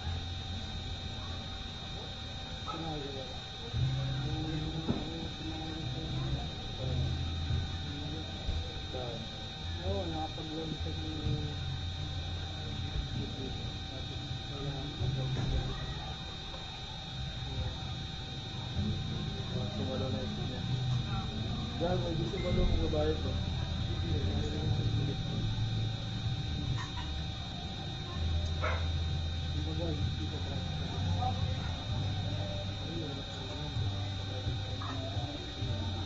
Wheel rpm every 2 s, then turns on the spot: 0, 0, 0, 0, 0, 0, 0, 0, 0, 0, 0, 0, 0, 0, 0, 0, 0, 0.
none